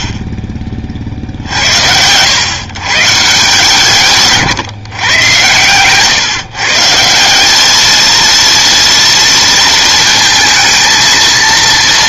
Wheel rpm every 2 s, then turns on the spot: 40, 120, 140, 140, 230, 220.
none